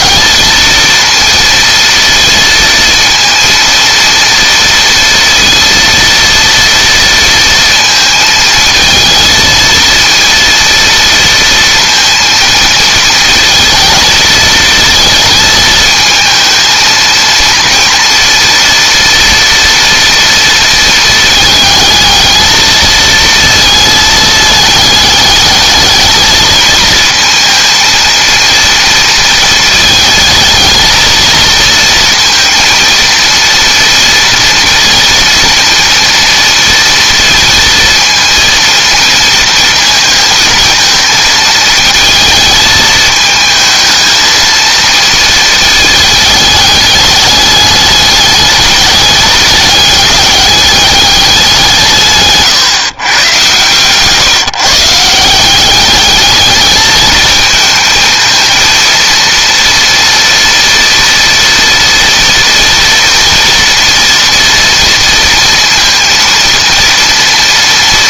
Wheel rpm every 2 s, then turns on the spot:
230, 230, 230, 230, 220, 230, 220, 230, 230, 230, 230, 220, 210, 220, 230, 220, 230, 230, 230, 230, 220, 220, 220, 200, 200, 200, 130, 150, 220, 230, 240, 230, 230, 230.
none